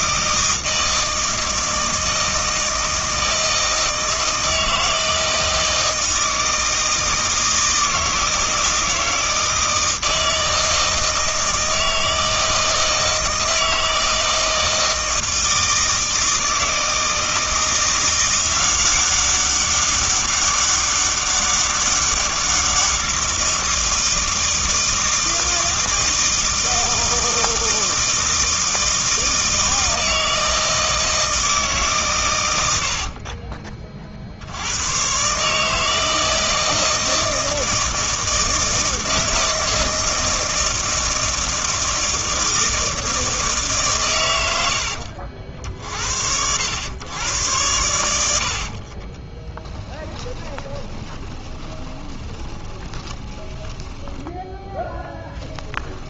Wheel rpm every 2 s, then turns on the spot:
160, 160, 160, 160, 160, 160, 160, 160, 160, 190, 200, 190, 160, 160, 160, 160, 90, 90, 160, 160, 160, 160, 80, 90, 50, 20, 20, 10.
48-56